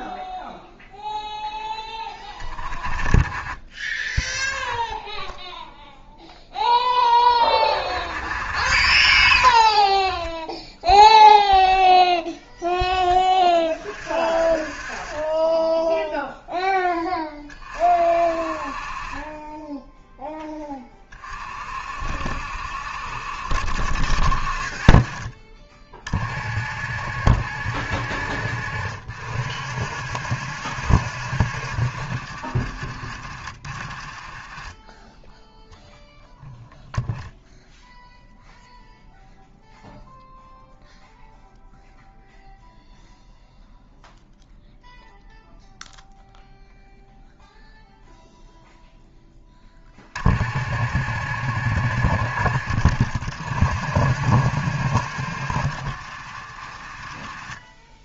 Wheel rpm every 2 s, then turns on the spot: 0, 30, 10, 10, 50, 10, 10, 30, 10, 40, 20, 60, 40, 60, 60, 70, 40, 10, 0, 0, 0, 0, 0, 0, 0, 60, 60, 70, 40.
none